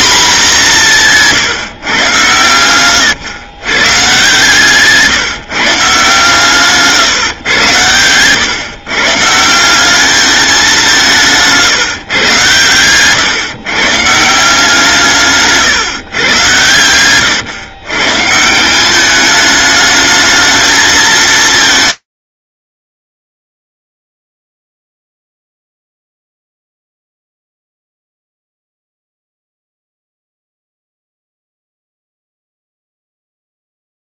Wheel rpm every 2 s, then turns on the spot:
180, 120, 150, 140, 130, 180, 120, 160, 110, 200, 220, 80, 0, 0, 0, 0, 0.
16-18